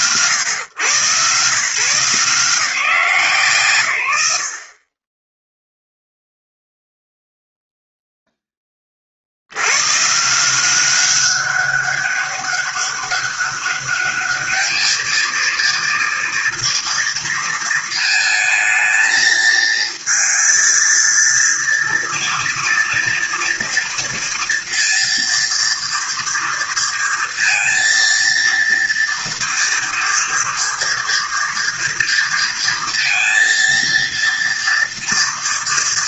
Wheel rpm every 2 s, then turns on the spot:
110, 150, 40, 0, 50, 190, 200, 220, 230, 220, 230, 230, 230, 230, 230, 240, 230, 230.
none